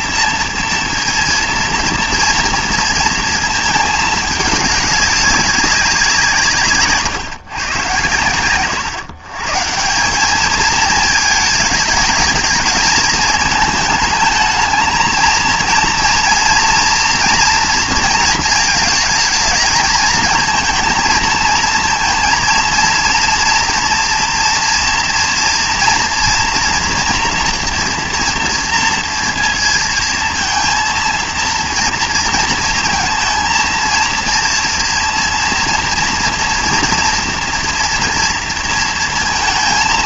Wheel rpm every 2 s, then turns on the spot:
230, 230, 200, 150, 130, 210, 220, 220, 230, 220, 220, 230, 230, 240, 230, 230, 230, 230, 230, 230.
none